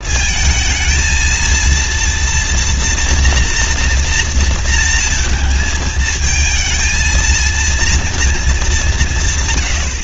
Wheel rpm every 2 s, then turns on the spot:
230, 240, 230, 220, 220.
none